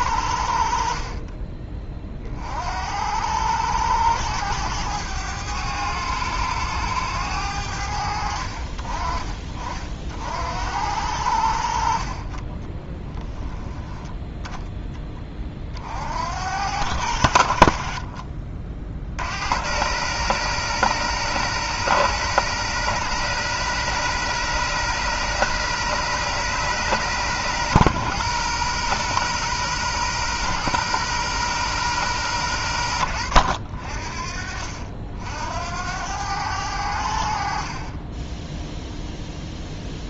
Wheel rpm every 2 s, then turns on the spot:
60, 60, 100, 100, 60, 70, 20, 10, 80, 40, 120, 120, 130, 120, 120, 120, 100, 50, 90, 10.
12-14